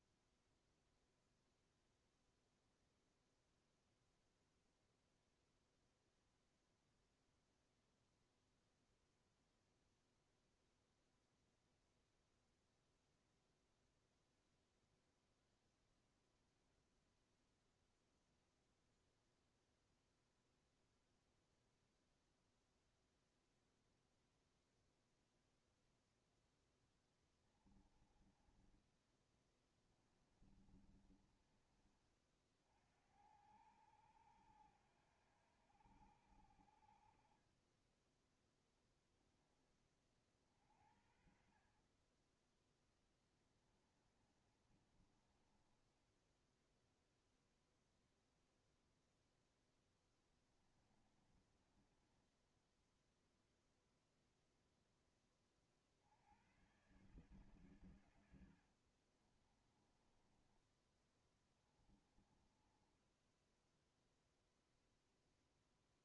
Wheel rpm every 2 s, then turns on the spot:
0, 0, 0, 0, 0, 0, 0, 0, 0, 0, 0, 0, 0, 0, 20, 20, 40, 90, 70, 10, 40, 20, 30, 10, 0, 20, 20, 0, 80, 90, 20, 20, 0.
28-32 44-48 50-54 58-60 62-64